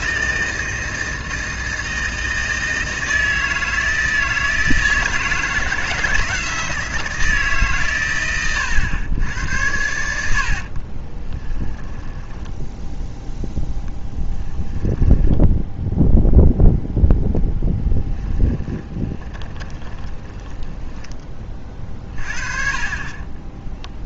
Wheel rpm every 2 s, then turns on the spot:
160, 160, 160, 160, 100, 50, 10, 10, 0, 20, 10, 40.
10-16 18-22